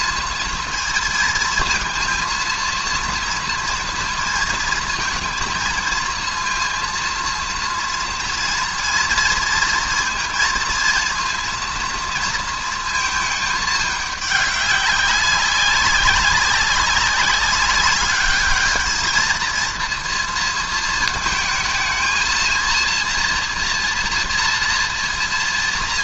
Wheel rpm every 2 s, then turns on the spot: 230, 230, 230, 230, 230, 230, 230, 200, 190, 210, 230, 230, 230.
none